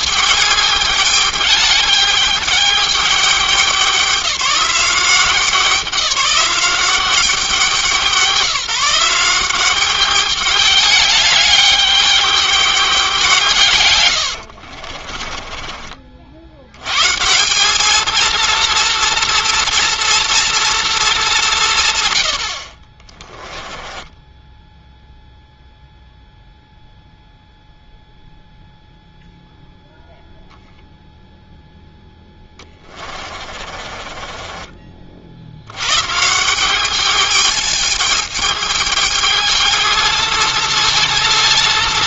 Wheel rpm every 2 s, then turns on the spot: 210, 210, 190, 190, 170, 210, 200, 60, 110, 230, 230, 50, 0, 0, 0, 10, 20, 30, 200, 220, 230.
14-16 32-36